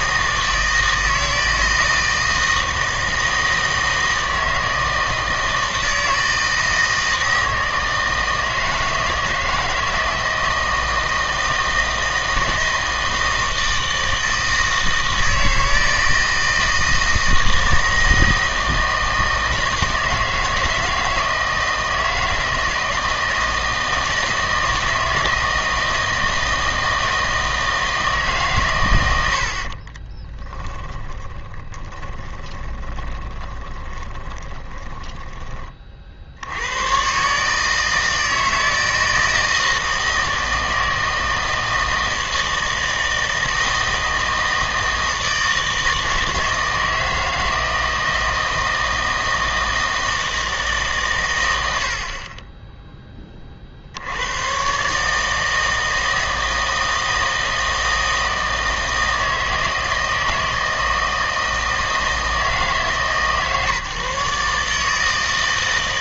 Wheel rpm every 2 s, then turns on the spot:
160, 160, 160, 160, 160, 160, 160, 160, 160, 160, 160, 160, 160, 160, 120, 10, 20, 20, 90, 160, 160, 160, 160, 160, 160, 150, 10, 130, 160, 160, 160, 160, 150.
30-36